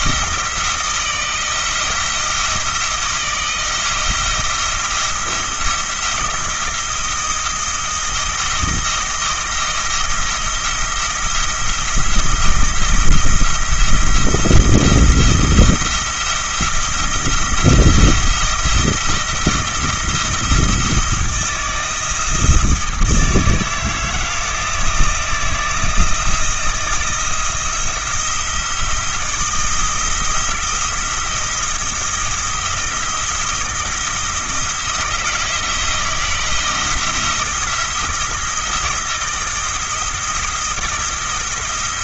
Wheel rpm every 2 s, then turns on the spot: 160, 160, 170, 170, 160, 170, 170, 170, 170, 170, 170, 160, 160, 160, 170, 170, 170, 160, 170, 160, 170.
none